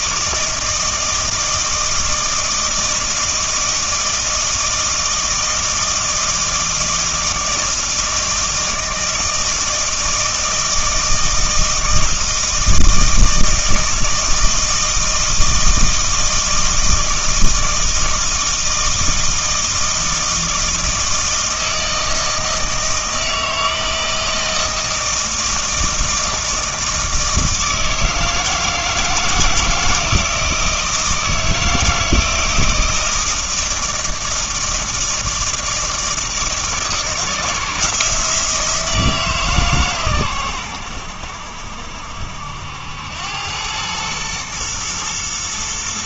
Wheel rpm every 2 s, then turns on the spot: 160, 160, 160, 160, 160, 160, 160, 160, 160, 160, 160, 160, 160, 160, 160, 160, 160, 160, 160, 160, 100, 80, 110.
none